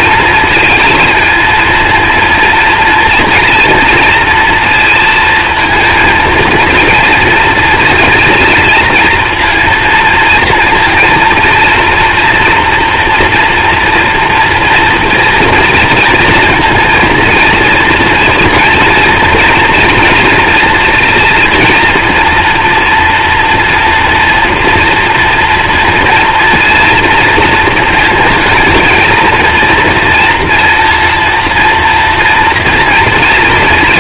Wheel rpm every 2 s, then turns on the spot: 230, 230, 230, 230, 230, 230, 230, 230, 230, 230, 230, 240, 230, 230, 230, 230, 230.
none